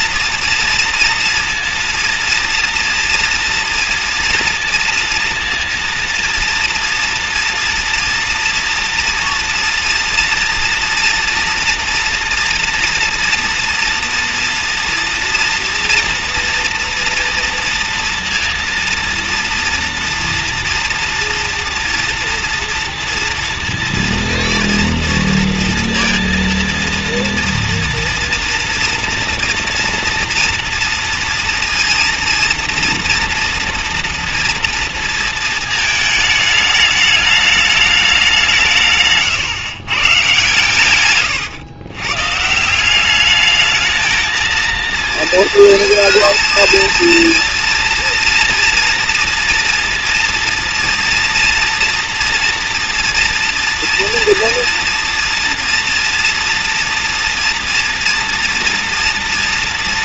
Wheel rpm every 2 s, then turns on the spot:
230, 230, 230, 230, 230, 230, 240, 230, 230, 230, 230, 230, 230, 230, 230, 230, 230, 230, 220, 170, 130, 160, 220, 230, 230, 230, 230, 230, 230, 240.
none